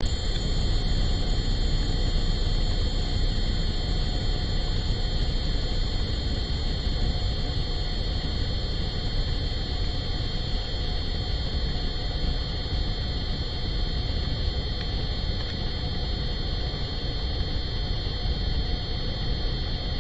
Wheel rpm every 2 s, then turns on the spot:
0, 0, 0, 0, 0, 0, 0, 0, 0, 0.
none